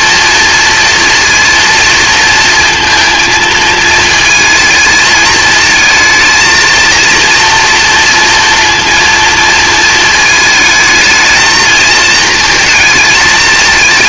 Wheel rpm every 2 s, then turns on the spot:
230, 220, 220, 230, 230, 220, 220.
none